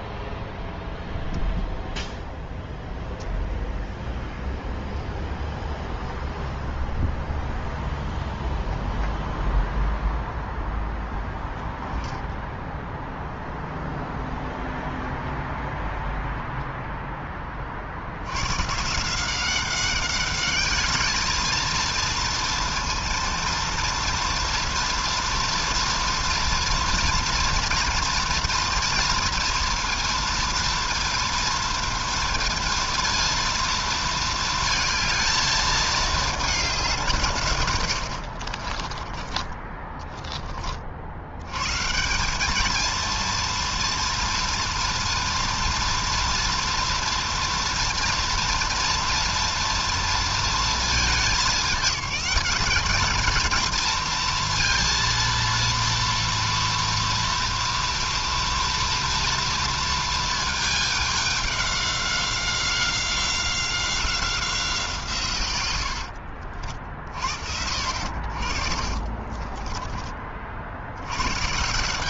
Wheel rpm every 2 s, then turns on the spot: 10, 0, 0, 0, 0, 10, 0, 0, 10, 180, 210, 230, 230, 230, 230, 230, 230, 220, 150, 30, 90, 230, 230, 230, 230, 210, 230, 230, 230, 230, 200, 190, 120, 60, 30, 110.
38-40 68-70